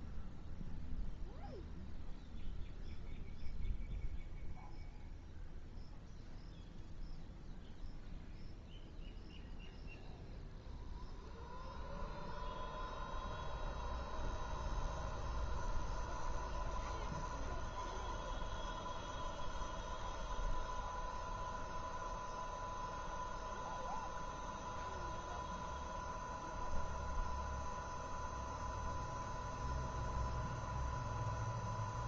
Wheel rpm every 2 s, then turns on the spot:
0, 0, 0, 0, 0, 0, 0, 0, 0, 0, 0, 0, 0, 0, 0, 0.
none